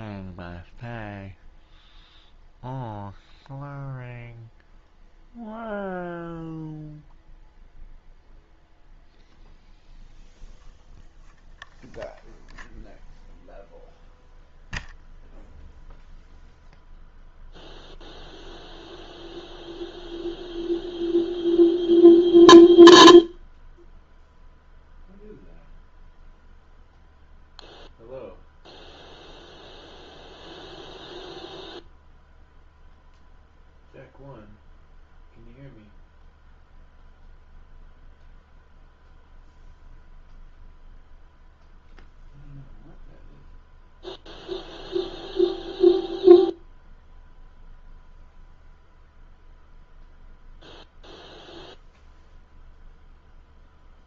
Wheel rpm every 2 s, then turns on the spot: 0, 0, 0, 0, 0, 0, 0, 0, 0, 0, 0, 0, 0, 0, 0, 0, 0, 0, 0, 0, 0, 0, 0, 0, 0, 0, 0.
none